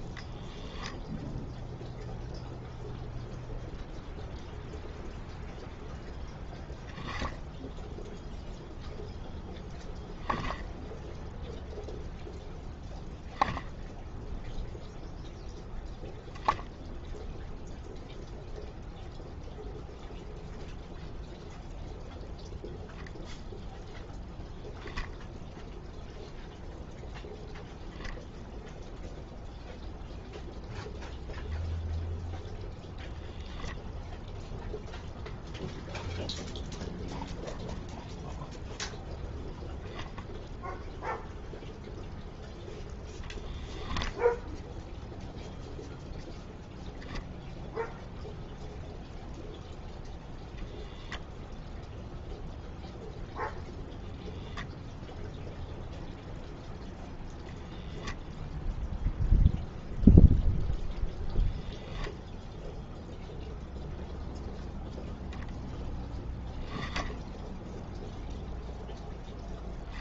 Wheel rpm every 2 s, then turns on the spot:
0, 0, 0, 0, 0, 0, 0, 0, 0, 0, 0, 0, 0, 0, 0, 0, 0, 0, 0, 0, 0, 0, 0, 0, 0, 0, 0, 0, 0, 0, 0, 0, 0, 0, 0.
none